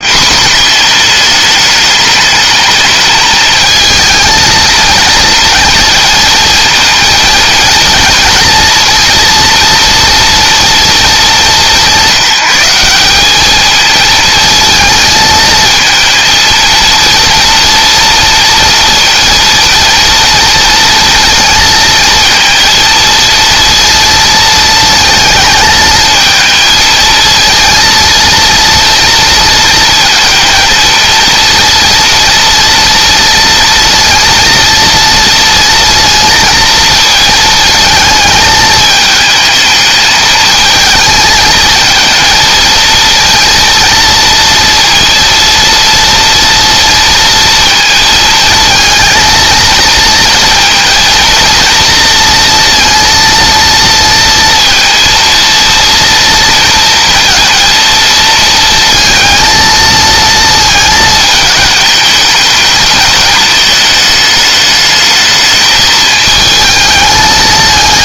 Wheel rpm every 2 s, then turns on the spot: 220, 210, 220, 230, 240, 220, 200, 220, 230, 230, 230, 230, 220, 220, 230, 230, 230, 230, 230, 220, 220, 230, 230, 230, 230, 230, 230, 230, 230, 230, 220, 220, 210, 220.
none